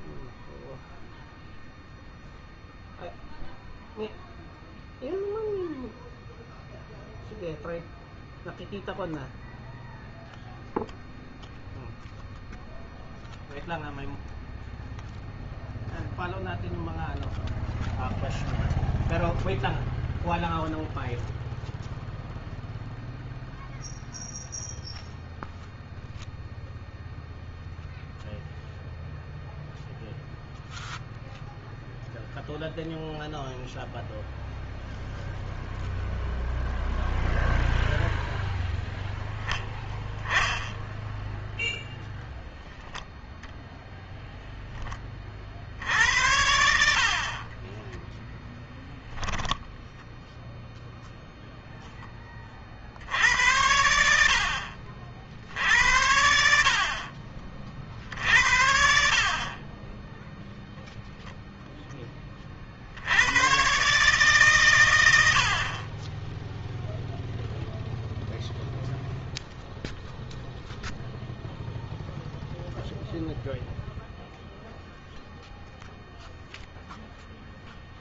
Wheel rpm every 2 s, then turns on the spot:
0, 0, 0, 0, 0, 0, 0, 0, 0, 0, 0, 0, 0, 0, 0, 0, 0, 0, 0, 0, 10, 0, 10, 70, 10, 0, 40, 60, 60, 60, 0, 40, 120, 0, 0, 0, 0, 0, 0.
48-50